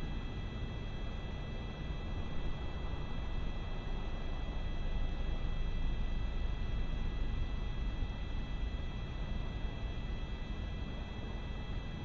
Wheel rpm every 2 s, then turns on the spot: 0, 0, 0, 0, 0, 0.
none